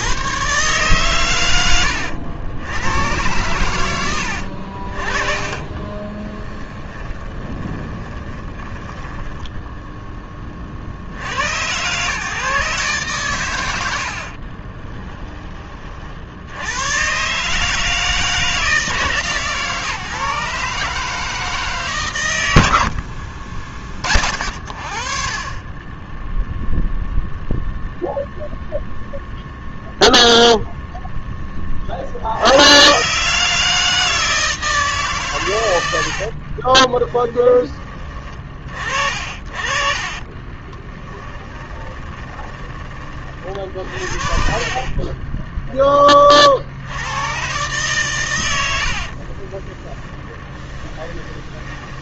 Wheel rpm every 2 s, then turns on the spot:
130, 100, 50, 10, 10, 70, 130, 20, 120, 150, 150, 70, 50, 0, 0, 0, 120, 150, 20, 40, 10, 30, 30, 80, 60, 10.
6-10 14-16 36-38 40-42 48-52